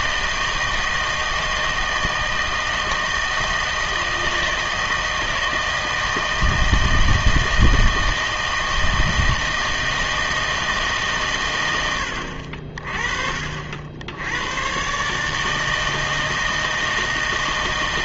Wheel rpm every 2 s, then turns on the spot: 160, 160, 160, 160, 160, 160, 40, 120, 160.
none